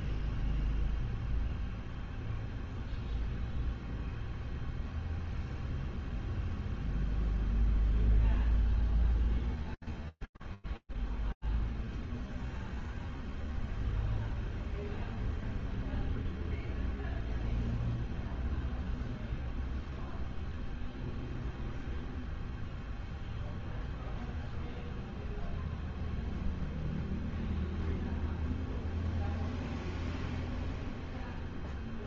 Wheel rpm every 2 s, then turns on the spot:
0, 0, 0, 0, 0, 0, 0, 0, 0, 0, 0, 0, 0, 0, 0, 0.
none